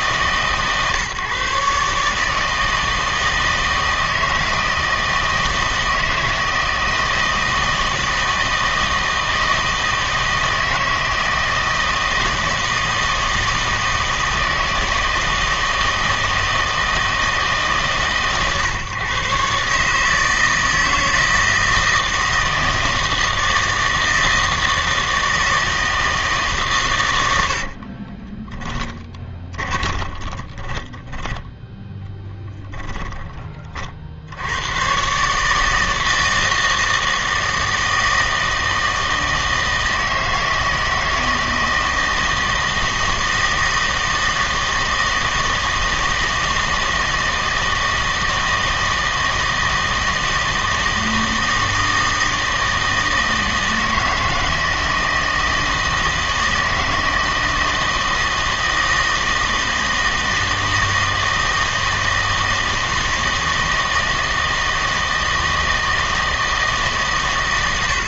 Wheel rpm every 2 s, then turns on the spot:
140, 160, 160, 160, 160, 160, 160, 160, 160, 130, 160, 160, 160, 140, 10, 20, 10, 100, 160, 160, 160, 160, 160, 160, 160, 160, 160, 160, 160, 160, 160, 160, 160, 160.
28-34